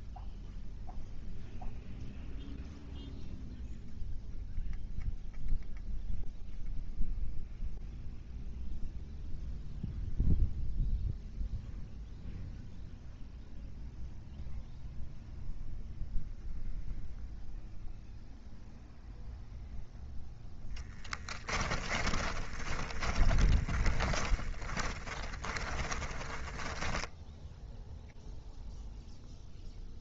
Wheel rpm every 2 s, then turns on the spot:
0, 0, 0, 0, 0, 0, 0, 0, 0, 0, 10, 20, 40, 10, 0.
20-28